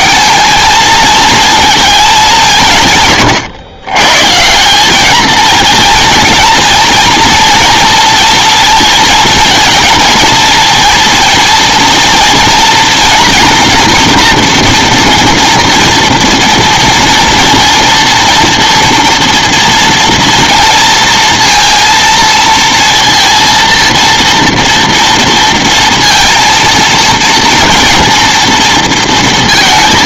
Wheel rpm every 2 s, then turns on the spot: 220, 150, 170, 230, 230, 230, 230, 240, 230, 230, 230, 230, 230, 230, 230.
none